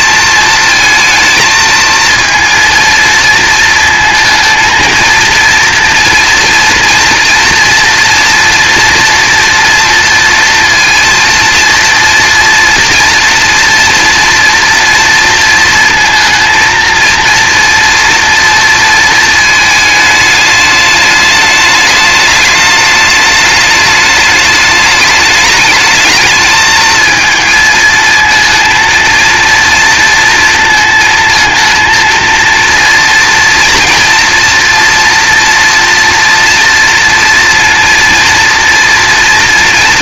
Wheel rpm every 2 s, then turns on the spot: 220, 230, 230, 230, 240, 230, 230, 230, 230, 220, 210, 210, 210, 220, 230, 230, 230, 230, 230, 230.
none